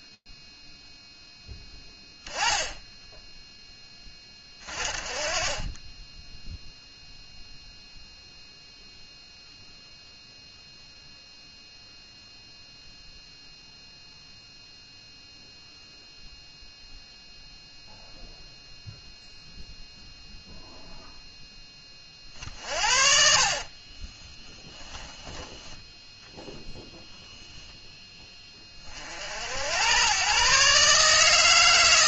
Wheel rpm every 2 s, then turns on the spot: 10, 0, 20, 0, 0, 0, 0, 0, 0, 0, 0, 50, 10, 0, 20, 140.
22-26